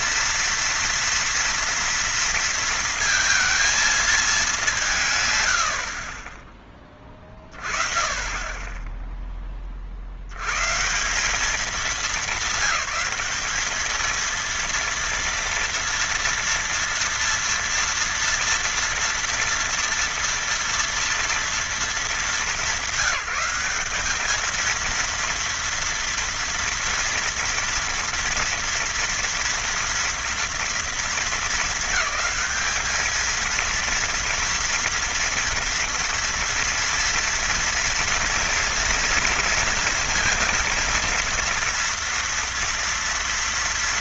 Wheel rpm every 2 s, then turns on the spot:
230, 230, 180, 20, 10, 110, 210, 230, 230, 230, 230, 200, 230, 230, 230, 230, 220, 230, 230, 230, 230, 240.
none